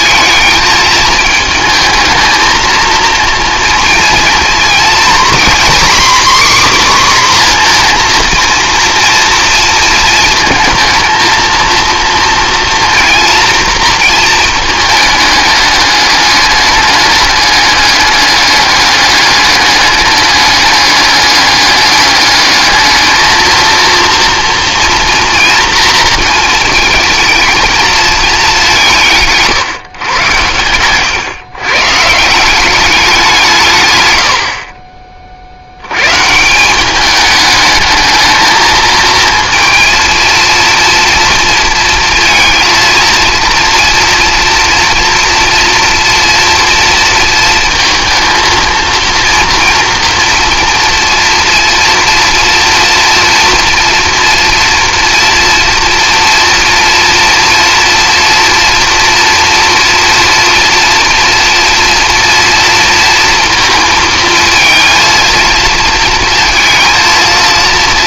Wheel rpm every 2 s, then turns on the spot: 220, 230, 250, 270, 230, 220, 230, 220, 210, 210, 200, 220, 240, 230, 190, 110, 190, 40, 190, 220, 230, 230, 230, 230, 230, 240, 230, 240, 240, 240, 230, 230, 220, 230.
none